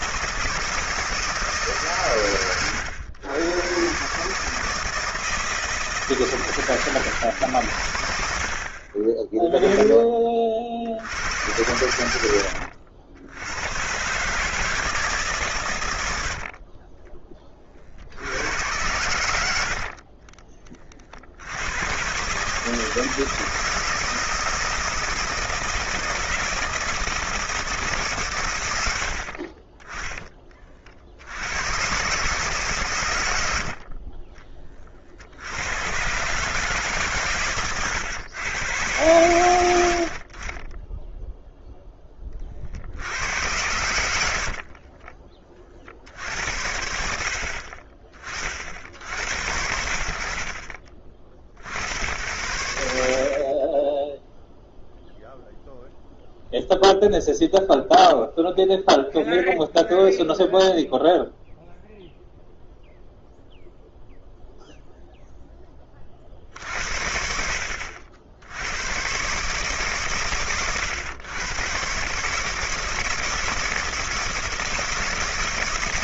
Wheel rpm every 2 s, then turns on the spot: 160, 100, 160, 150, 60, 50, 90, 150, 50, 90, 30, 150, 160, 160, 110, 40, 140, 40, 140, 100, 20, 50, 50, 70, 80, 40, 80, 0, 0, 0, 0, 0, 0, 60, 90, 120, 160, 160.
16-18 44-46